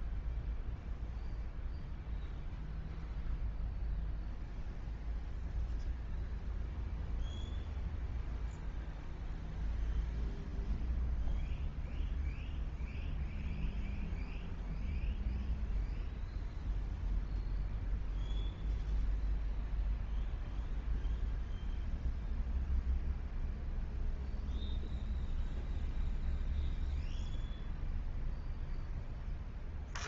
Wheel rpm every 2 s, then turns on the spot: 0, 0, 0, 0, 0, 0, 0, 0, 0, 0, 0, 0, 0, 0, 0.
none